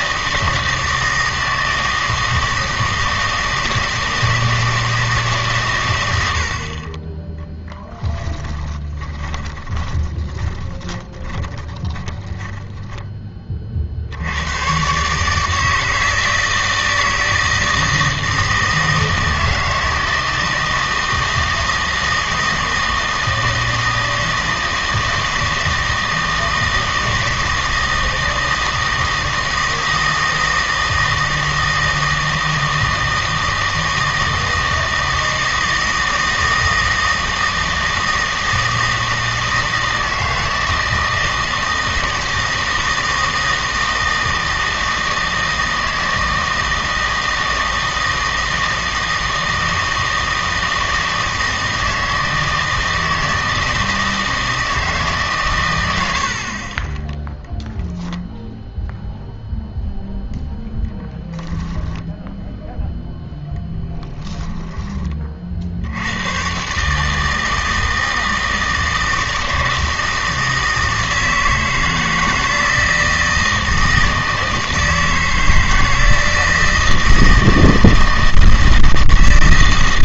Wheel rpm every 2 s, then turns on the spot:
160, 160, 160, 50, 20, 20, 20, 120, 160, 160, 160, 160, 160, 160, 160, 160, 160, 160, 160, 160, 160, 160, 160, 160, 160, 160, 160, 160, 30, 0, 0, 0, 20, 130, 160, 160, 160, 160, 160, 160.
8-14 64-66